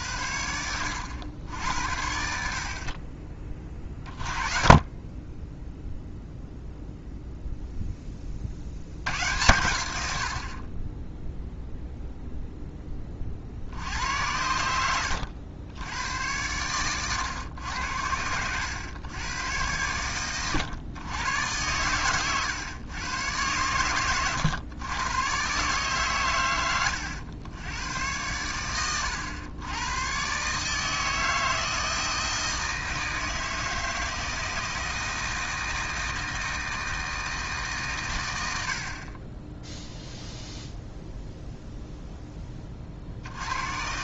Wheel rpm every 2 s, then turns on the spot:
90, 40, 20, 0, 80, 20, 20, 80, 110, 110, 120, 120, 110, 100, 100, 160, 160, 160, 160, 30, 0, 50.
none